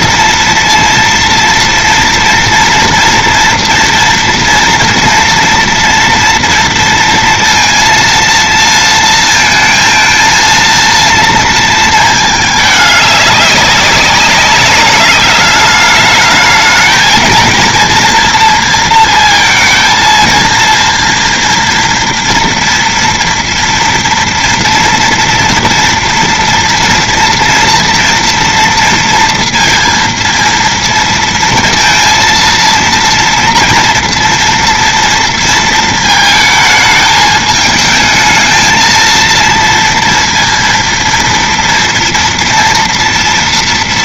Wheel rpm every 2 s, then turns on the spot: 230, 230, 230, 230, 230, 230, 210, 190, 210, 230, 230, 240, 230, 230, 230, 230, 230, 230, 220, 220, 230, 240.
none